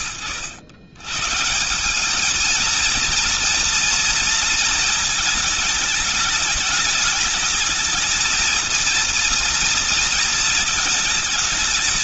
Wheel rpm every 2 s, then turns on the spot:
110, 220, 220, 220, 230, 220.
none